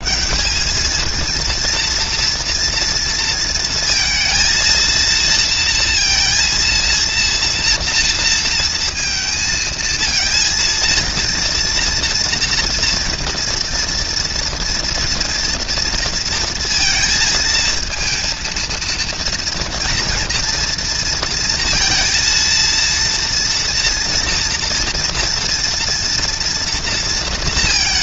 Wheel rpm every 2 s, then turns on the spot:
120, 230, 220, 230, 230, 220, 230, 230, 230, 220, 230, 230, 230, 240.
none